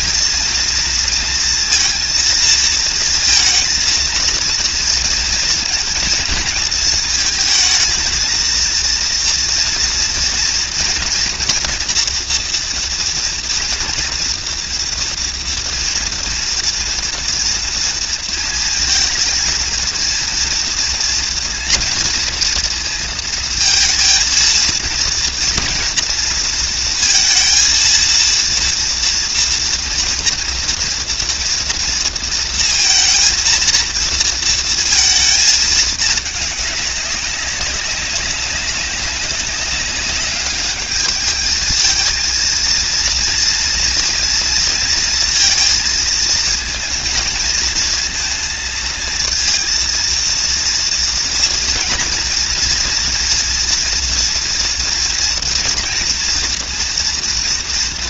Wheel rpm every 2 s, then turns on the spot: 230, 230, 230, 220, 230, 230, 230, 230, 230, 230, 230, 230, 230, 230, 230, 230, 230, 220, 200, 200, 210, 230, 230, 230, 230, 230, 240, 230, 230.
none